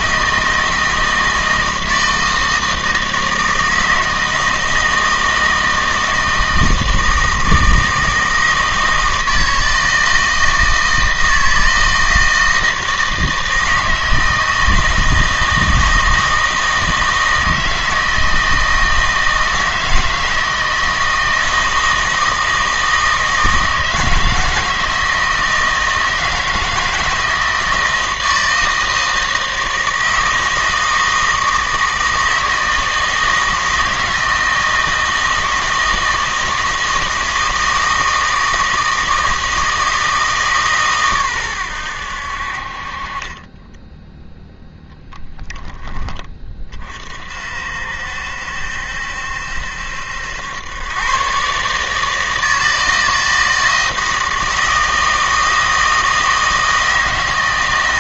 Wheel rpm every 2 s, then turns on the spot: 160, 160, 160, 160, 160, 160, 160, 160, 160, 160, 160, 160, 160, 160, 160, 160, 160, 160, 160, 160, 140, 50, 0, 30, 70, 110, 160, 160, 160.
none